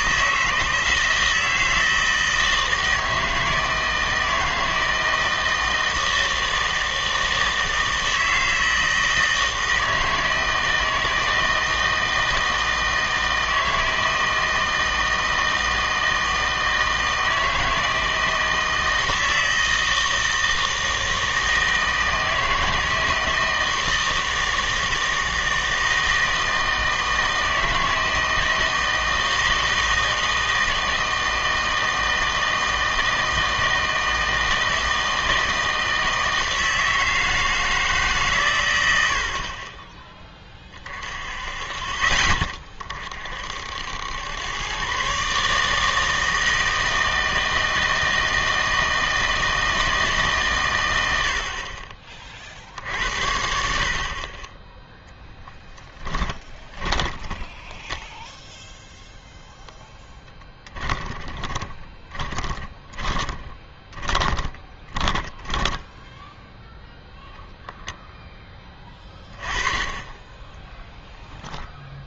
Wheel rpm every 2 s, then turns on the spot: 160, 160, 160, 160, 160, 160, 160, 160, 160, 160, 160, 160, 160, 160, 160, 160, 160, 160, 160, 110, 30, 20, 120, 160, 160, 110, 60, 10, 20, 0, 10, 20, 20, 10, 20, 10.
56-58 60-66